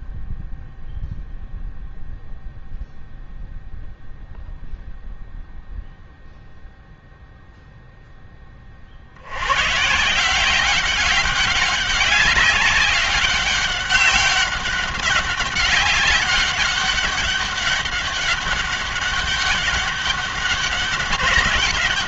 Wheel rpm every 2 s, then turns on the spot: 0, 0, 0, 0, 50, 190, 200, 200, 200, 200, 200.
none